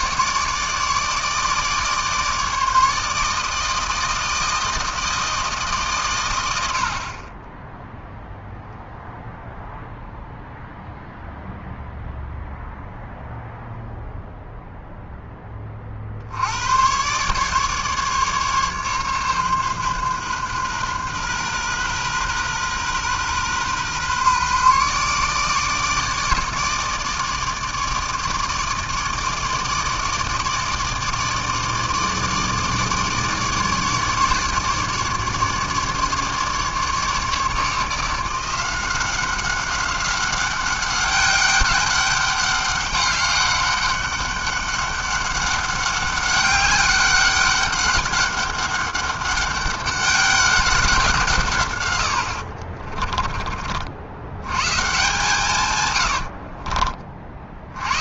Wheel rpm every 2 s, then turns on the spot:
150, 160, 160, 90, 0, 0, 0, 0, 90, 140, 130, 130, 140, 150, 160, 150, 150, 150, 150, 180, 190, 200, 200, 200, 200, 190, 50, 120, 60.
52-54 56-58